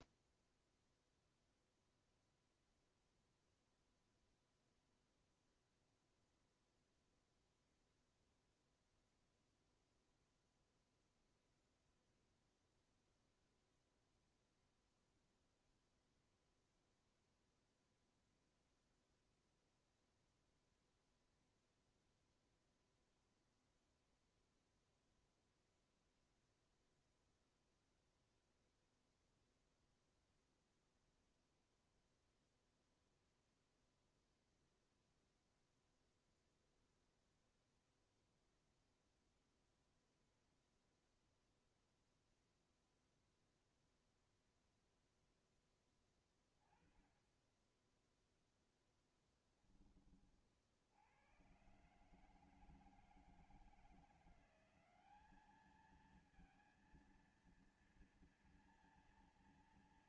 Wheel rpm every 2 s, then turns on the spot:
0, 0, 0, 0, 0, 0, 0, 0, 0, 0, 0, 0, 0, 0, 0, 0, 0, 0, 0, 0, 0, 0, 0, 20, 10, 70, 160, 190, 230, 240.
none